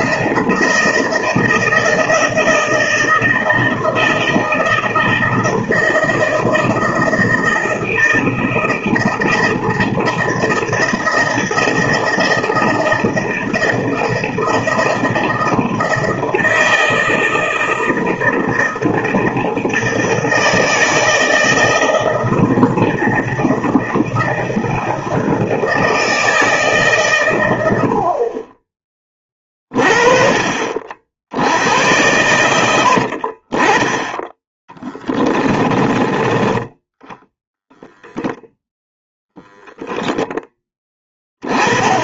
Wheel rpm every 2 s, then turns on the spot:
160, 160, 160, 160, 160, 160, 160, 160, 160, 160, 160, 160, 160, 150, 20, 40, 80, 10, 10, 0, 10.
32-36